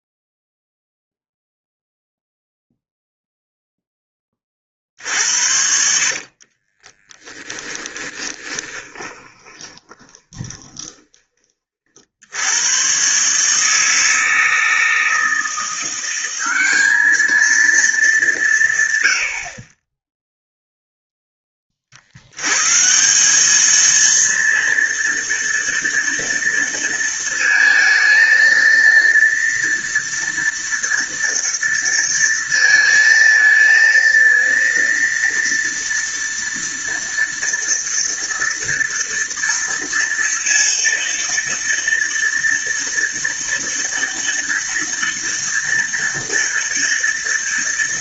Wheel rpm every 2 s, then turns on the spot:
0, 0, 40, 30, 20, 20, 100, 160, 190, 140, 0, 120, 230, 230, 230, 230, 230, 230, 230, 230, 230, 230, 230, 230.
6-12